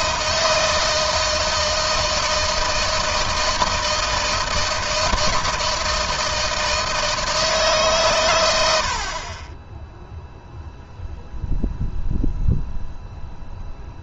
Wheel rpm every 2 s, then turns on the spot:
160, 160, 160, 160, 60, 0, 0.
none